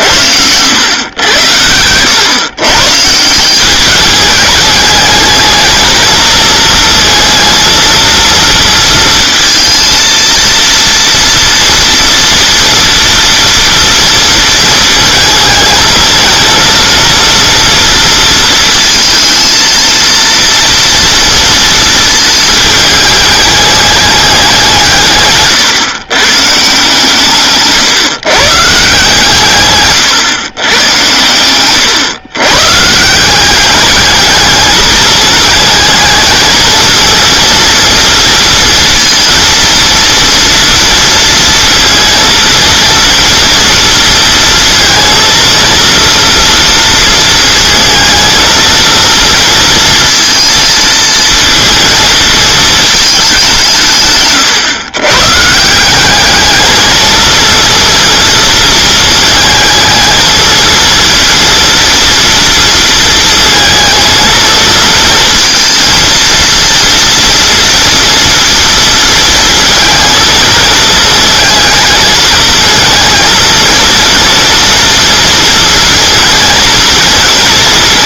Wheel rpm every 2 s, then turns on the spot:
100, 130, 210, 230, 230, 230, 230, 220, 230, 230, 230, 220, 160, 140, 140, 110, 140, 220, 230, 230, 230, 230, 230, 230, 230, 230, 220, 120, 220, 220, 220, 230, 230, 230, 230, 220, 220, 230, 230.
none